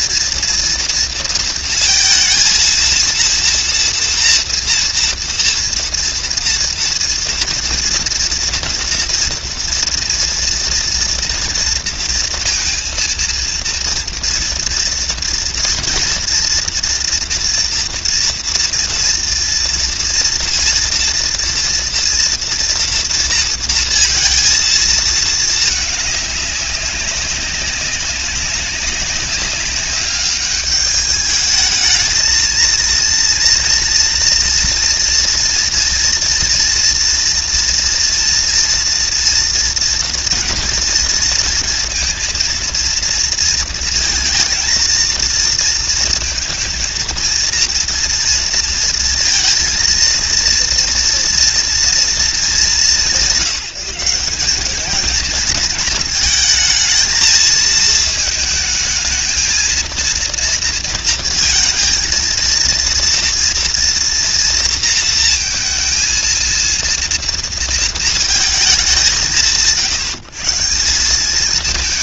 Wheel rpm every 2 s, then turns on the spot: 230, 230, 230, 230, 230, 230, 230, 230, 230, 230, 230, 230, 230, 200, 200, 200, 230, 240, 230, 230, 240, 230, 230, 230, 230, 230, 210, 200, 220, 220, 230, 230, 230, 230, 210, 160.
none